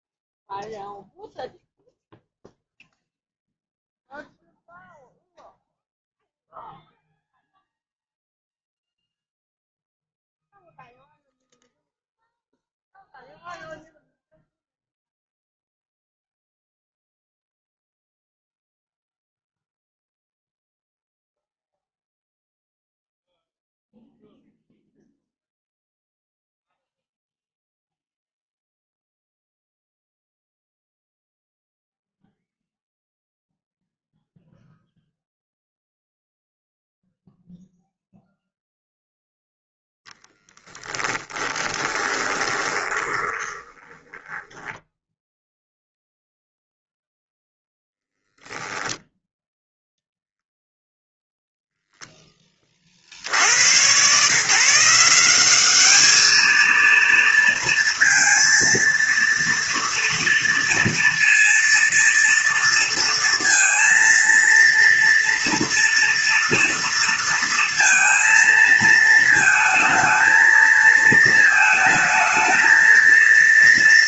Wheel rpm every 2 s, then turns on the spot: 0, 0, 0, 0, 0, 0, 0, 0, 0, 0, 0, 0, 0, 0, 0, 0, 0, 0, 0, 0, 10, 20, 10, 0, 0, 0, 20, 150, 230, 230, 230, 230, 230, 230, 230, 220, 230.
40-46